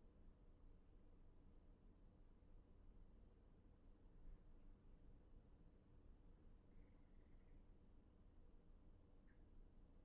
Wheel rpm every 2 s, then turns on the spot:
0, 0, 0, 0, 0.
none